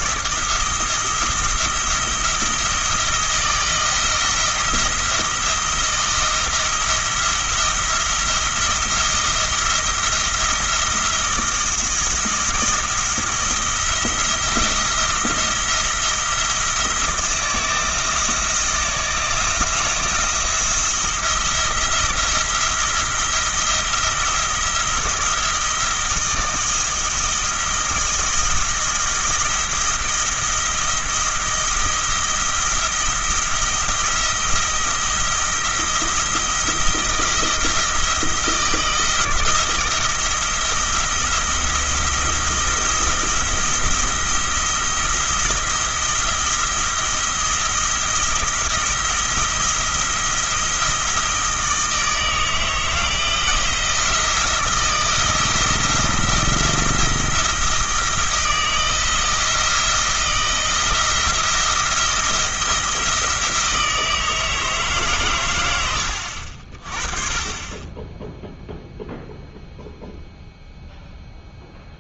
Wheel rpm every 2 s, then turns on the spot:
170, 170, 170, 170, 170, 170, 170, 170, 160, 160, 170, 170, 170, 170, 170, 170, 170, 170, 170, 170, 170, 170, 170, 170, 170, 170, 160, 170, 170, 160, 170, 170, 150, 50, 0, 0.
none